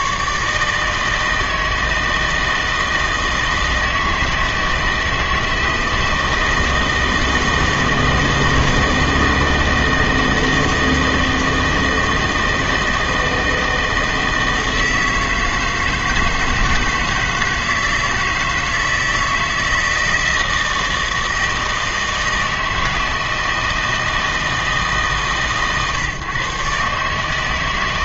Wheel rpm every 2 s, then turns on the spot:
160, 160, 160, 160, 160, 160, 160, 160, 160, 160, 160, 160, 150, 140.
none